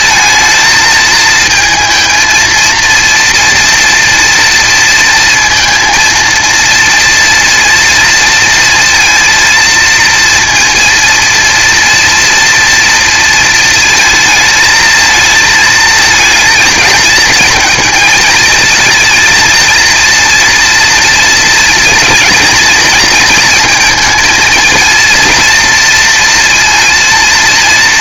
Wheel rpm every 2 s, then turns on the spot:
220, 230, 230, 230, 230, 230, 230, 220, 220, 230, 230, 220, 230, 230.
none